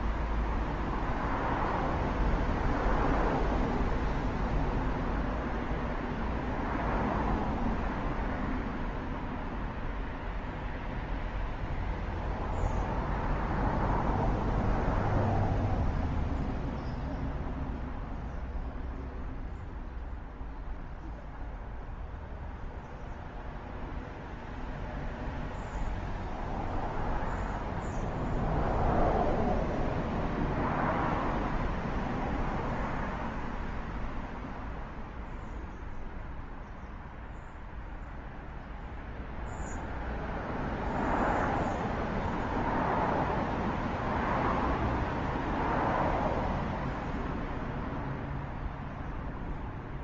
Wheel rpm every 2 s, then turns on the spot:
0, 0, 0, 0, 0, 0, 0, 0, 0, 0, 0, 0, 0, 0, 0, 0, 0, 0, 0, 0, 0, 0, 0, 0, 0.
none